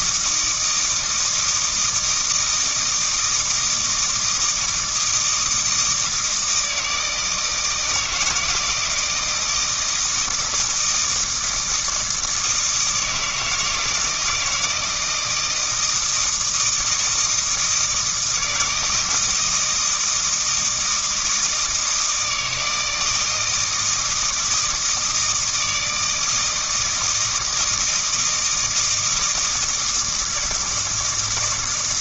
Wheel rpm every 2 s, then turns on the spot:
160, 160, 160, 160, 170, 160, 160, 160, 160, 160, 160, 160, 160, 160, 160, 160.
none